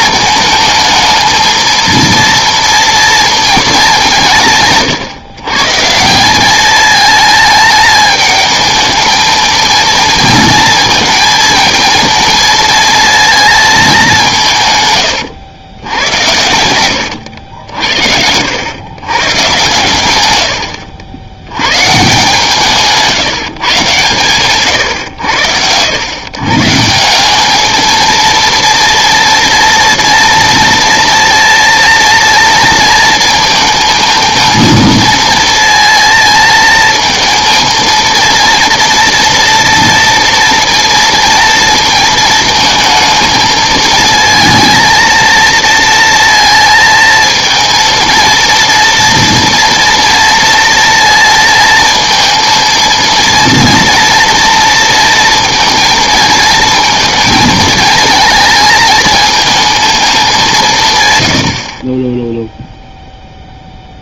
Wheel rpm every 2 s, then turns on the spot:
230, 230, 150, 210, 210, 220, 230, 140, 80, 100, 90, 160, 120, 150, 230, 230, 230, 230, 230, 230, 230, 230, 230, 220, 230, 230, 230, 230, 230, 220, 170, 0.
16-18